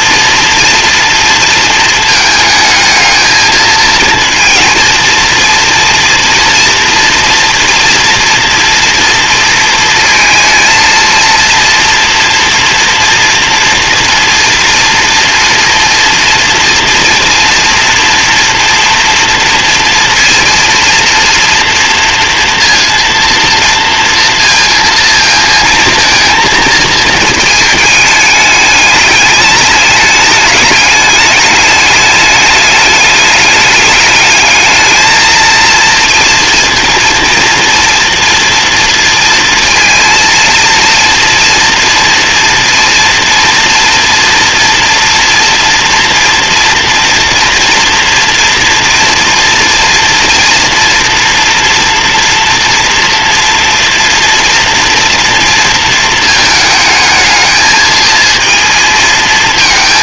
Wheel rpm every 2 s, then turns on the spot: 230, 220, 230, 230, 240, 230, 230, 230, 230, 230, 230, 230, 230, 220, 210, 210, 210, 220, 230, 230, 230, 230, 230, 230, 230, 230, 230, 230, 220, 230.
none